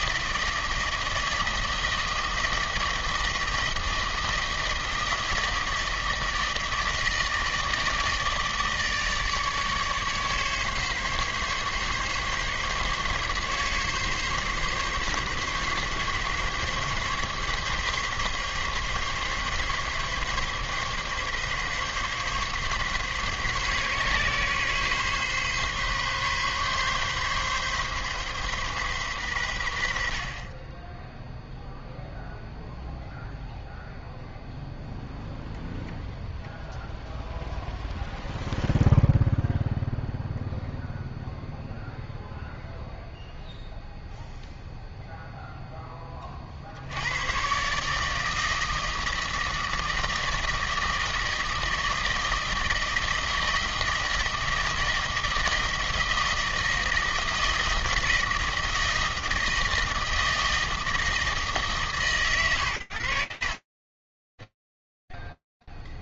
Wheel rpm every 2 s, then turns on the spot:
160, 160, 160, 160, 150, 140, 140, 140, 140, 140, 140, 140, 140, 140, 130, 20, 0, 0, 0, 0, 0, 0, 0, 90, 160, 160, 160, 160, 160, 160, 160, 100, 0.
none